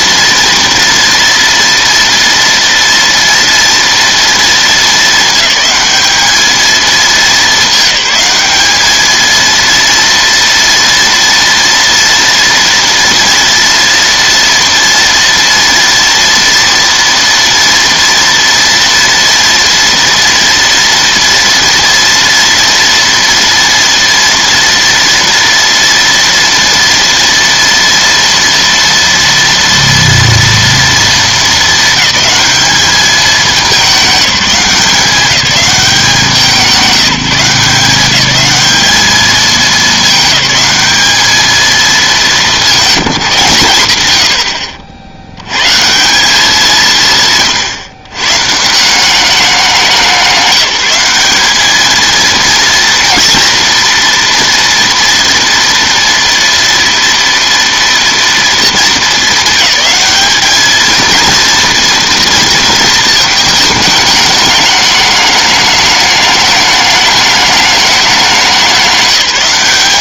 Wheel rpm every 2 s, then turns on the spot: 230, 230, 220, 220, 220, 230, 230, 230, 230, 230, 230, 230, 230, 230, 230, 230, 220, 180, 180, 210, 210, 190, 70, 170, 170, 190, 230, 230, 230, 220, 220, 230, 210, 210, 200.
none